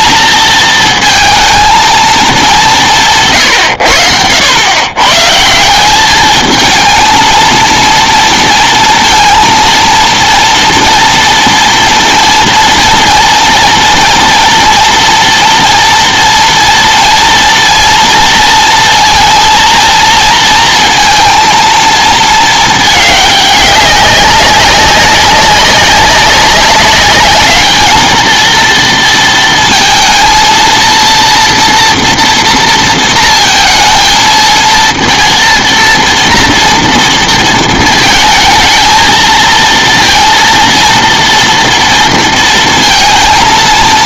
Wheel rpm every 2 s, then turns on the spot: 230, 190, 100, 220, 230, 230, 230, 230, 230, 230, 230, 220, 190, 200, 230, 230, 230, 230, 230, 220, 230, 230.
none